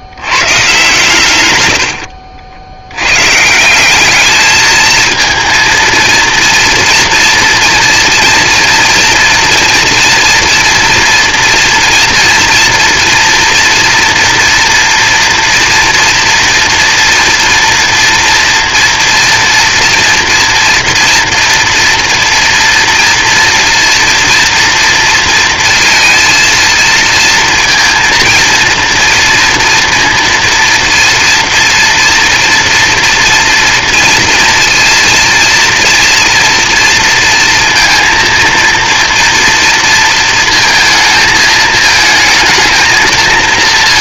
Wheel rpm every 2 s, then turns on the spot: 130, 80, 220, 240, 230, 230, 230, 230, 230, 240, 230, 230, 230, 230, 230, 230, 230, 230, 230, 230, 220, 220.
none